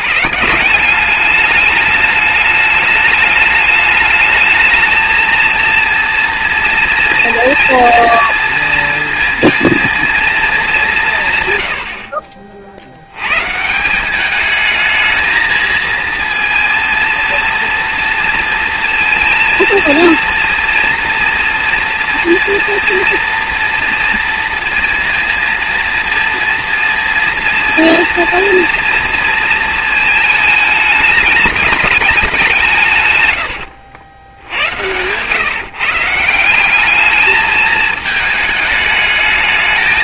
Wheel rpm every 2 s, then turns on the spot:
200, 210, 220, 230, 230, 170, 100, 220, 230, 230, 230, 230, 230, 230, 230, 210, 140, 120, 210, 220.
32-34